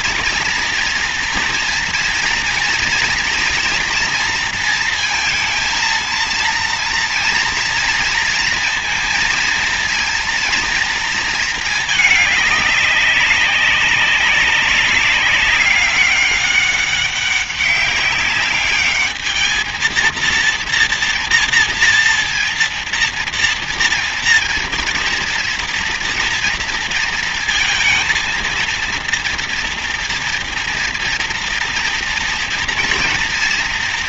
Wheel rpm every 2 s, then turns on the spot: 230, 230, 230, 230, 230, 230, 210, 190, 200, 200, 230, 240, 230, 230, 230, 230, 230.
none